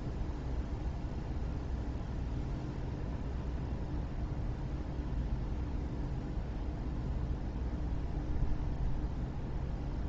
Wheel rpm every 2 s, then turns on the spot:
0, 0, 0, 0, 0.
none